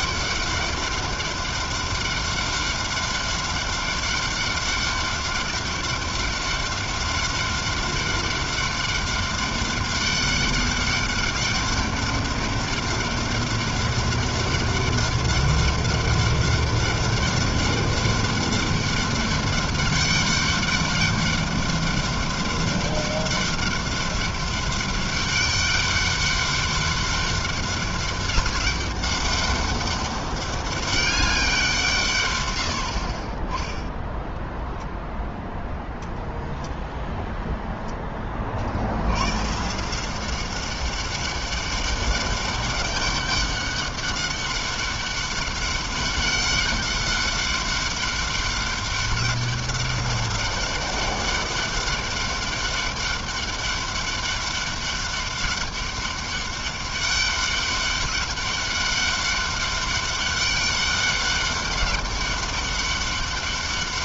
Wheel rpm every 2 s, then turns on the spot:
200, 200, 200, 200, 200, 200, 200, 200, 200, 200, 200, 200, 200, 200, 200, 190, 30, 0, 0, 110, 200, 200, 200, 200, 200, 200, 200, 200, 200, 200, 200, 200.
none